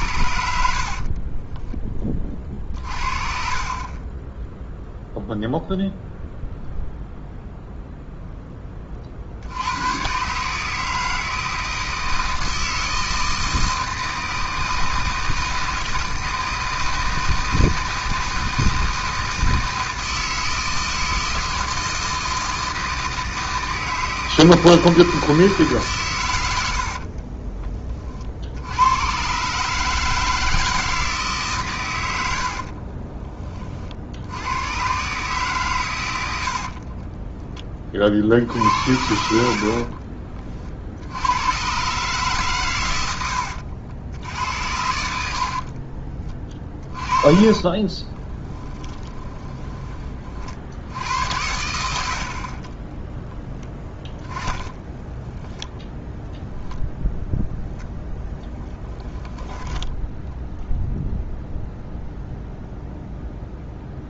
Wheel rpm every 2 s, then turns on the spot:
70, 30, 10, 0, 20, 150, 160, 160, 160, 160, 160, 160, 160, 90, 90, 160, 50, 110, 50, 70, 50, 110, 90, 30, 10, 60, 30, 10, 0, 20, 0, 0.
0-2 4-6 26-28 32-34 36-38 44-50